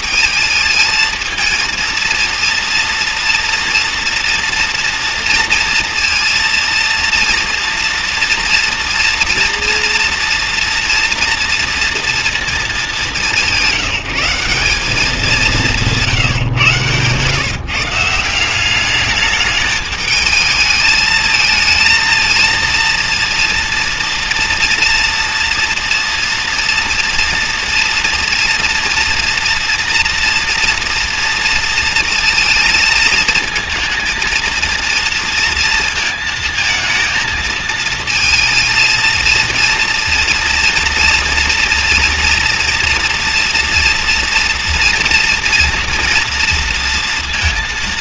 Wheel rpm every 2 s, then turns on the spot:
230, 230, 230, 230, 230, 230, 210, 200, 130, 210, 220, 230, 240, 240, 230, 230, 230, 230, 220, 230, 230, 230, 230, 230.
none